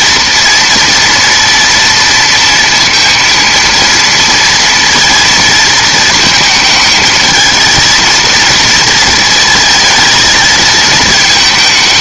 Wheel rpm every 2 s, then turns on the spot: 230, 230, 230, 220, 230, 220.
none